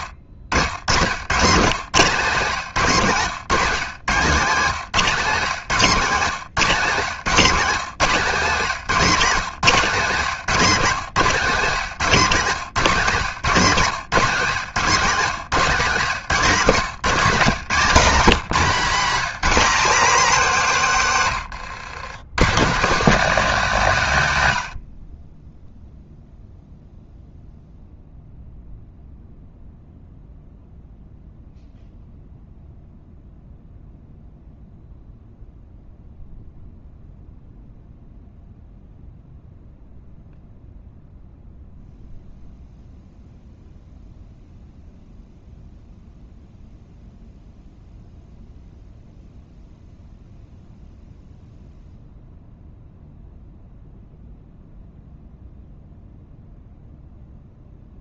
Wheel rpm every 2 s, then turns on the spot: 120, 170, 170, 170, 180, 180, 170, 170, 170, 200, 190, 190, 80, 0, 0, 0, 0, 0, 0, 0, 0, 0, 0, 0, 0, 0, 0, 0, 0.
none